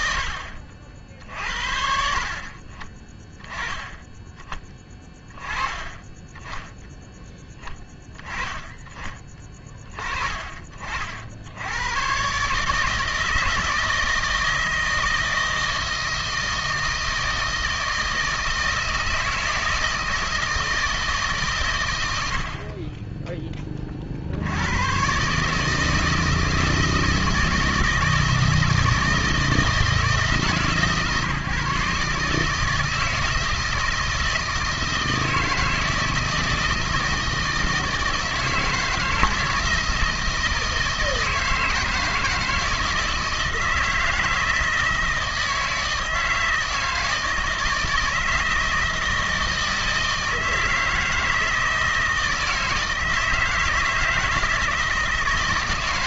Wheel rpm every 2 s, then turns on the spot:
60, 50, 20, 10, 20, 40, 140, 160, 160, 160, 160, 60, 70, 160, 160, 150, 150, 160, 160, 160, 160, 160, 160, 160, 160, 160, 160, 160.
0-4